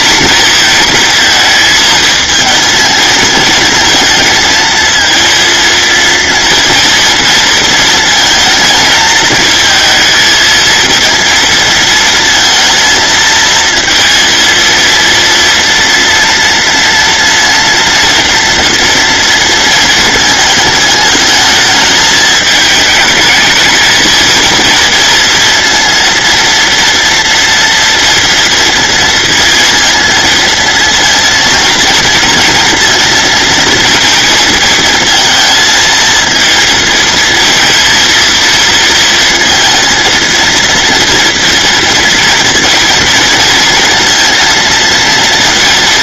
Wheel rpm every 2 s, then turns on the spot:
230, 230, 230, 230, 230, 230, 230, 230, 230, 230, 220, 220, 230, 230, 230, 230, 230, 220, 230, 230, 230, 230, 230.
none